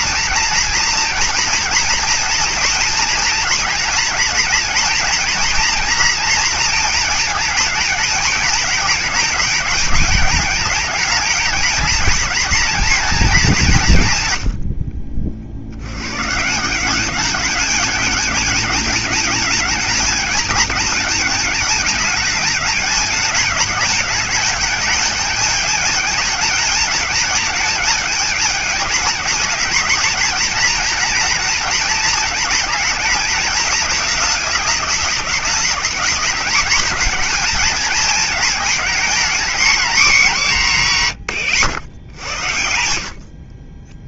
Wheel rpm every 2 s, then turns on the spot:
230, 230, 230, 230, 220, 220, 220, 60, 170, 210, 220, 210, 210, 220, 210, 230, 220, 200, 220, 220, 190, 80.
14-16